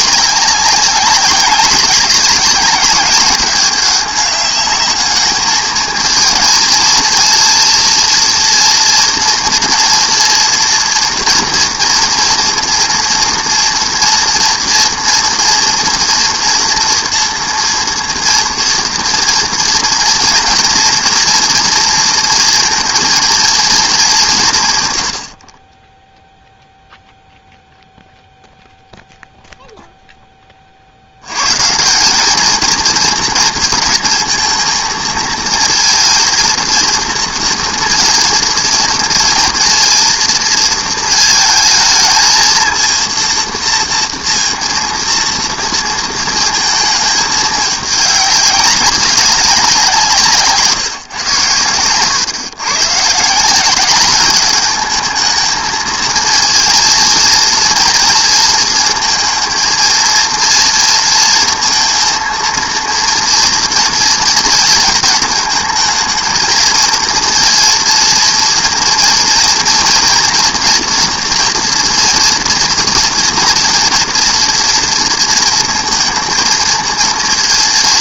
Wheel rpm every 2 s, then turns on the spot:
190, 200, 210, 220, 230, 240, 240, 230, 240, 230, 230, 240, 150, 0, 0, 30, 220, 230, 220, 230, 230, 220, 230, 220, 200, 160, 120, 210, 230, 220, 230, 230, 220, 220, 240, 240, 230, 230, 230.
none